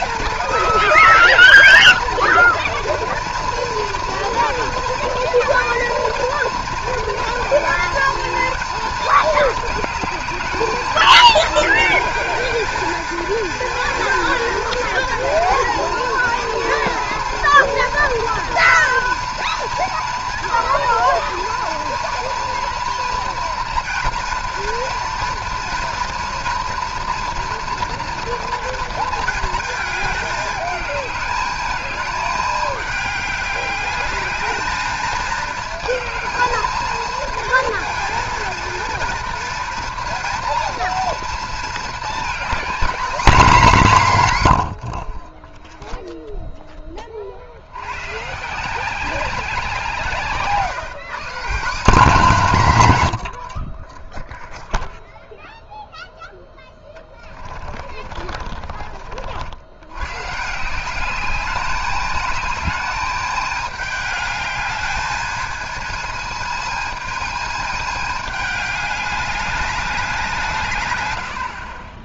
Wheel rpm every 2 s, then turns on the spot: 230, 230, 230, 230, 230, 220, 220, 230, 230, 230, 230, 230, 230, 240, 230, 210, 210, 210, 220, 230, 230, 230, 120, 0, 160, 140, 160, 0, 10, 40, 150, 210, 210, 220, 210, 160.
56-60